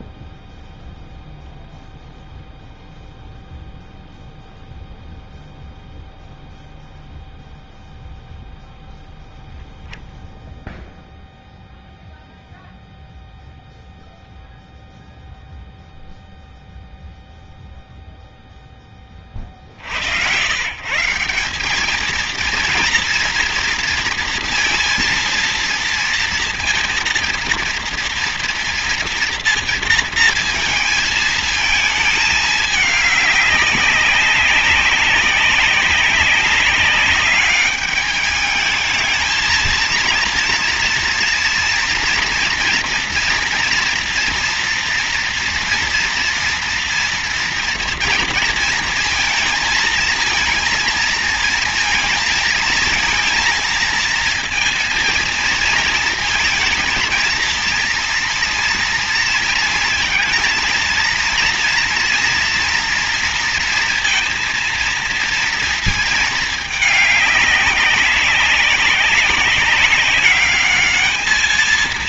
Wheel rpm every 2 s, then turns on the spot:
0, 0, 0, 0, 0, 0, 0, 0, 0, 10, 140, 230, 230, 230, 230, 230, 210, 190, 200, 220, 230, 230, 230, 230, 230, 230, 220, 230, 230, 230, 230, 230, 230, 210, 190, 210.
none